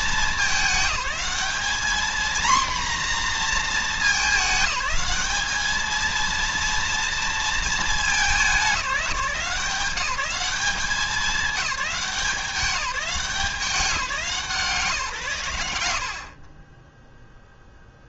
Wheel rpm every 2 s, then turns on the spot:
200, 240, 210, 230, 200, 200, 190, 160, 40.
none